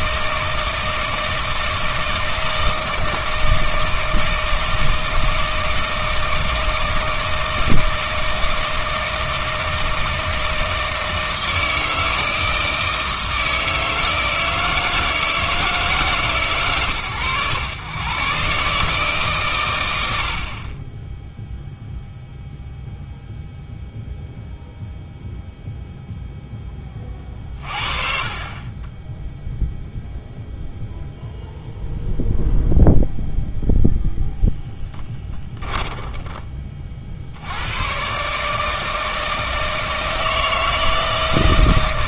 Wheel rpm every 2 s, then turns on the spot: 160, 160, 160, 160, 160, 160, 160, 160, 120, 140, 40, 0, 0, 10, 30, 0, 0, 0, 30, 150, 160.
none